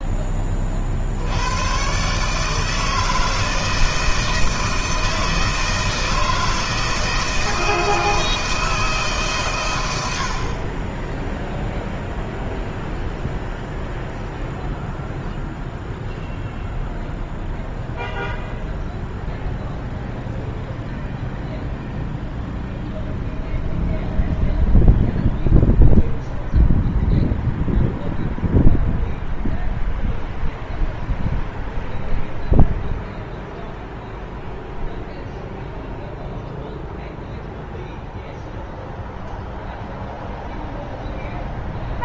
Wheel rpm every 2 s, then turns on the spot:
60, 160, 160, 160, 150, 20, 0, 0, 0, 0, 0, 0, 0, 0, 0, 0, 0, 0, 0, 0, 0.
none